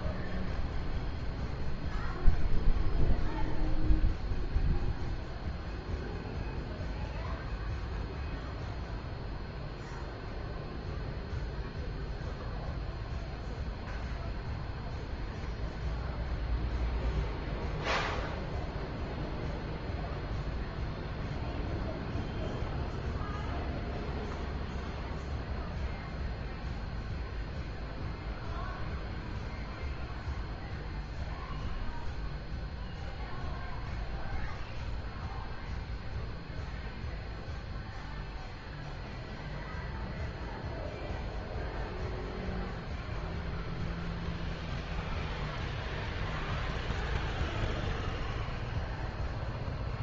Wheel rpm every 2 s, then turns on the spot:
0, 0, 0, 0, 0, 0, 0, 0, 0, 0, 0, 0, 0, 0, 0, 0, 0, 0, 0, 0, 0, 0, 0, 0, 0.
none